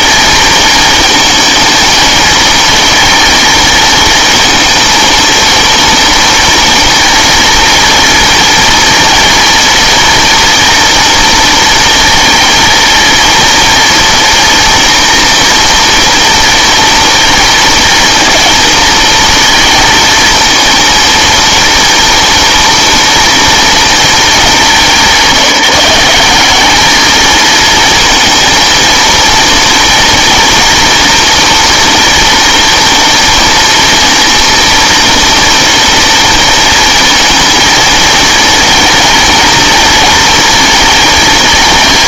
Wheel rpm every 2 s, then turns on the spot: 220, 230, 230, 240, 240, 230, 230, 230, 230, 230, 230, 230, 210, 200, 230, 230, 230, 240, 230, 220, 230.
none